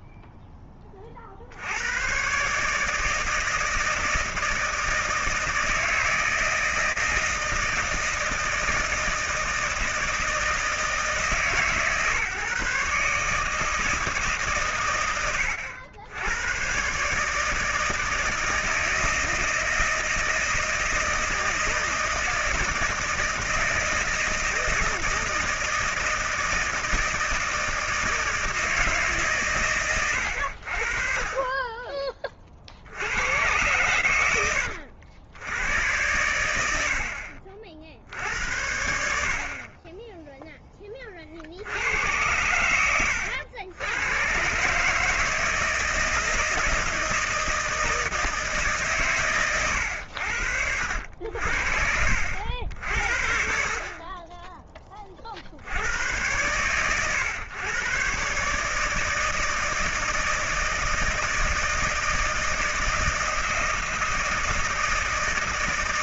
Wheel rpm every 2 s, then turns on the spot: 10, 140, 160, 160, 160, 160, 150, 140, 100, 160, 160, 160, 160, 160, 160, 70, 50, 90, 80, 80, 10, 90, 130, 160, 150, 80, 80, 20, 110, 140, 160, 160, 170.
none